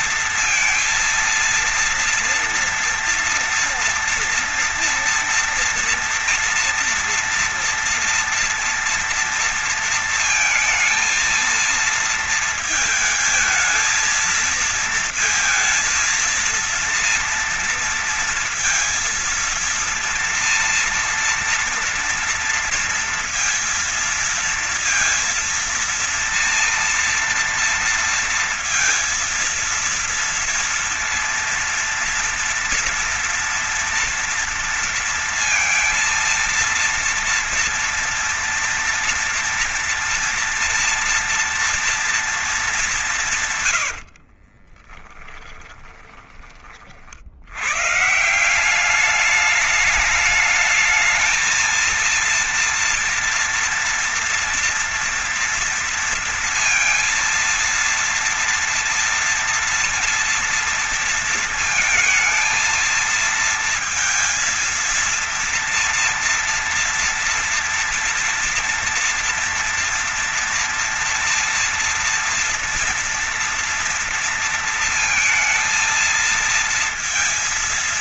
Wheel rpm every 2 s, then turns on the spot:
230, 230, 230, 230, 230, 230, 220, 230, 230, 230, 230, 230, 230, 230, 230, 230, 240, 230, 230, 230, 230, 190, 30, 60, 200, 210, 230, 230, 230, 230, 230, 230, 230, 230, 230, 230, 230, 230, 230.
44-46